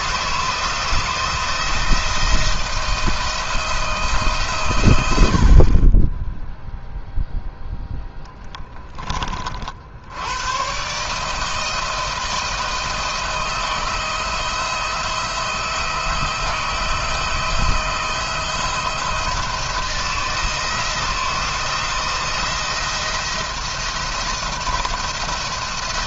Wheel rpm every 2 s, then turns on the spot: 160, 160, 110, 0, 20, 140, 160, 170, 170, 170, 160, 170, 170.
none